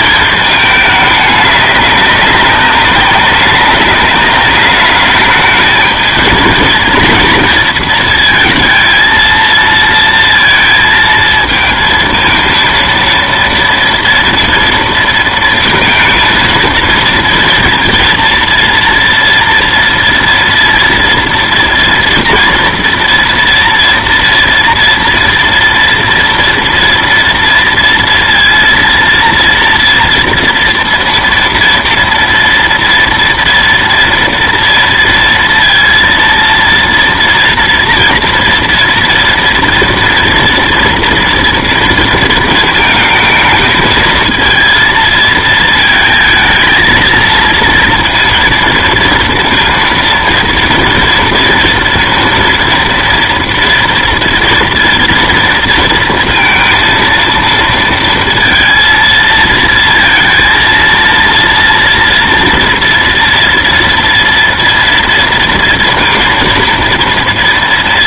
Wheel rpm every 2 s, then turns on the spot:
220, 200, 200, 230, 220, 230, 230, 230, 220, 230, 230, 230, 230, 230, 230, 230, 230, 230, 230, 230, 230, 220, 230, 220, 230, 230, 230, 230, 230, 230, 230, 230, 230, 230.
none